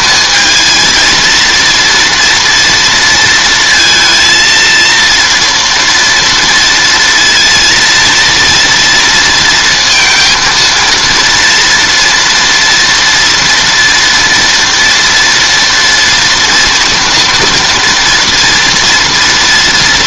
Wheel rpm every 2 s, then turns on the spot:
220, 230, 230, 230, 230, 230, 230, 230, 230, 230.
none